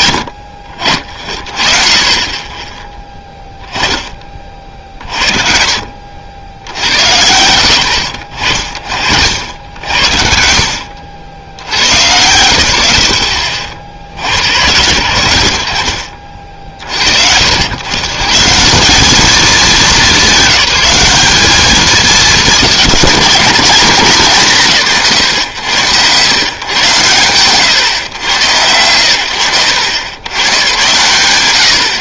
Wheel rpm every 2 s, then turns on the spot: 60, 20, 50, 90, 50, 70, 110, 100, 50, 170, 210, 200, 160, 110, 90, 90.
none